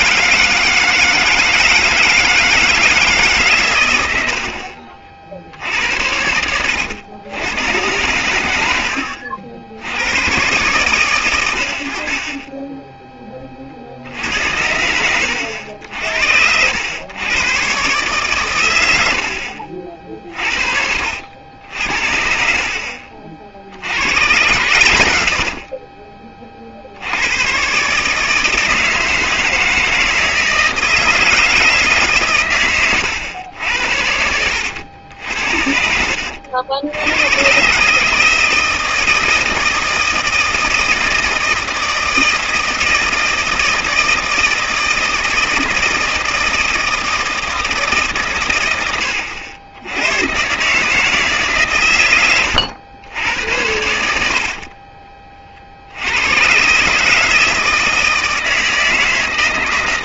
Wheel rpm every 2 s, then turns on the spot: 160, 150, 60, 100, 80, 130, 10, 80, 100, 90, 60, 50, 110, 60, 160, 160, 110, 80, 80, 160, 160, 160, 160, 160, 100, 150, 100, 30, 140, 160.
4-6 22-26